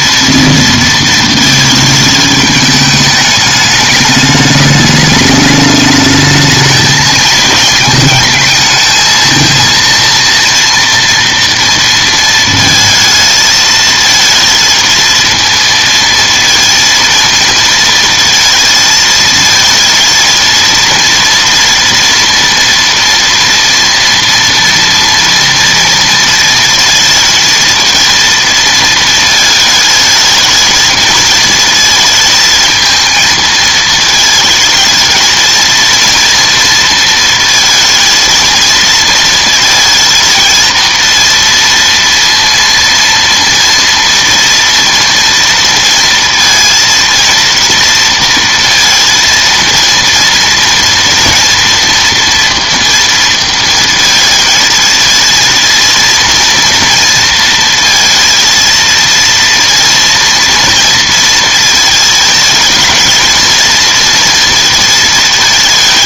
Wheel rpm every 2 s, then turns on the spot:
230, 210, 210, 220, 220, 230, 230, 230, 230, 220, 230, 230, 230, 230, 230, 220, 220, 220, 230, 230, 230, 230, 230, 230, 230, 230, 230, 220, 230, 230, 230, 220, 230.
none